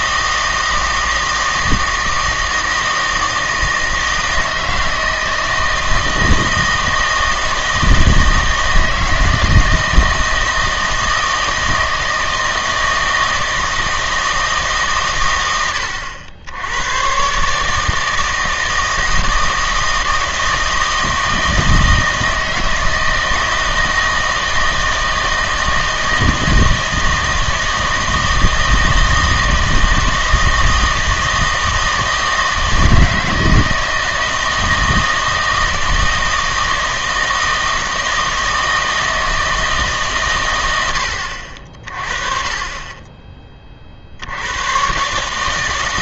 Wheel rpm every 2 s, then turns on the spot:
160, 160, 160, 160, 160, 160, 160, 140, 90, 160, 160, 160, 160, 160, 160, 160, 160, 160, 160, 160, 90, 20, 110.
none